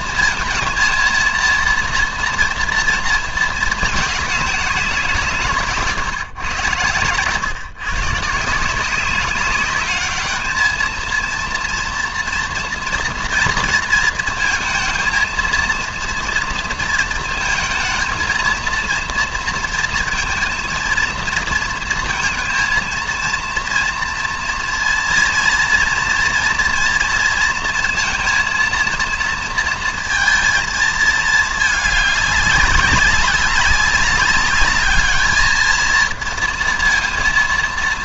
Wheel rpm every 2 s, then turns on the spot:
230, 240, 200, 110, 170, 220, 230, 230, 230, 230, 230, 230, 230, 230, 230, 230, 190, 200, 230.
none